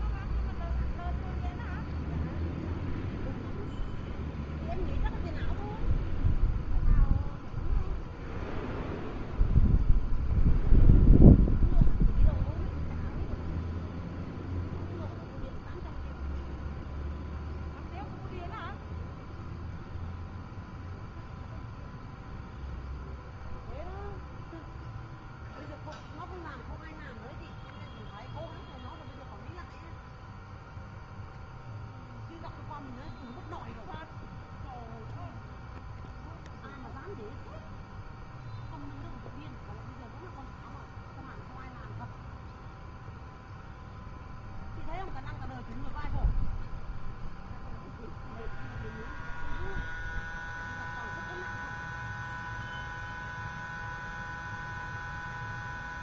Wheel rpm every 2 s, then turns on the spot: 0, 0, 0, 0, 0, 0, 0, 0, 0, 0, 0, 0, 0, 0, 0, 0, 0, 0, 0, 0, 0, 0, 0, 0, 0, 0, 0, 0.
none